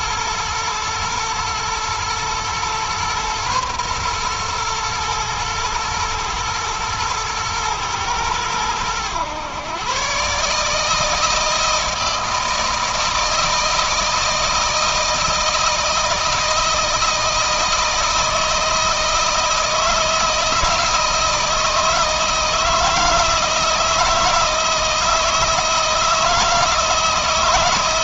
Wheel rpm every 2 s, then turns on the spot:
110, 120, 120, 110, 110, 150, 160, 160, 160, 160, 160, 160, 160, 160.
none